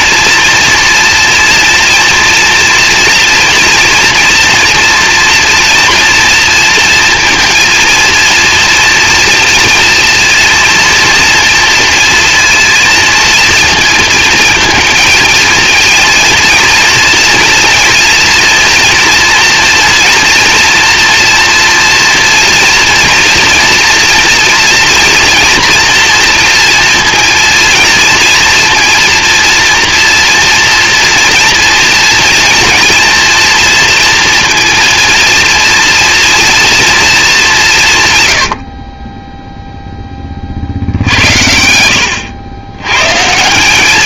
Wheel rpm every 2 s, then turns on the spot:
230, 230, 230, 230, 230, 230, 230, 230, 230, 230, 230, 230, 240, 230, 230, 230, 230, 230, 230, 40, 60, 120.
none